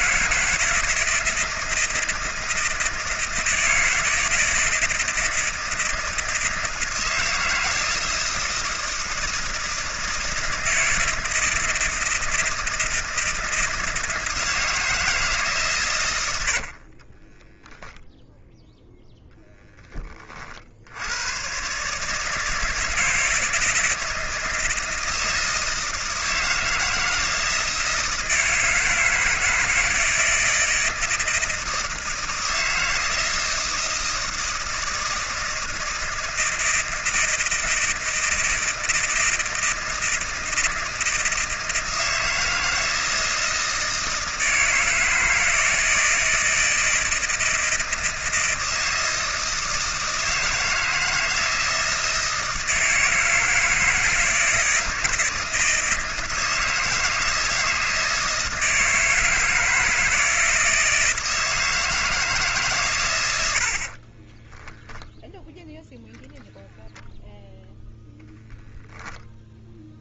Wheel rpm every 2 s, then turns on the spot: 170, 160, 160, 160, 160, 160, 160, 160, 60, 0, 60, 160, 160, 160, 160, 160, 160, 160, 160, 160, 160, 160, 160, 160, 160, 160, 160, 160, 160, 160, 160, 130, 0, 0, 0.
16-18